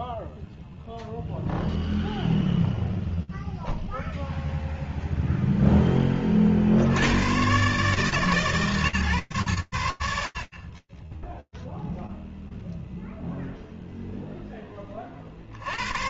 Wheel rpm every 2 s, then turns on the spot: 0, 0, 40, 130, 70, 0, 0, 110.
none